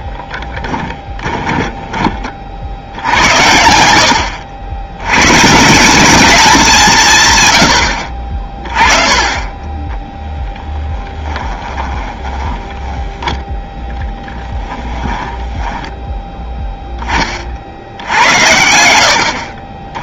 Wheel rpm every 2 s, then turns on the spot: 10, 70, 80, 180, 30, 10, 10, 10, 10, 80.
0-2 14-16